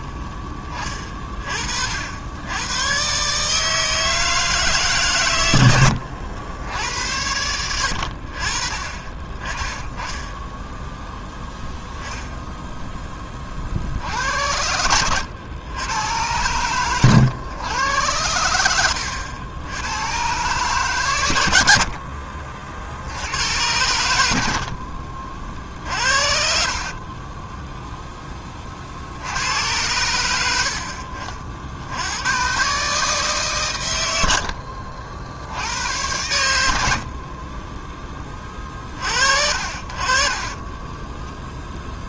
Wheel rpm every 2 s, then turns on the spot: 30, 120, 150, 80, 30, 0, 10, 80, 110, 80, 120, 80, 50, 40, 60, 60, 140, 70, 70, 40, 20.
16-18 26-28 34-36 40-42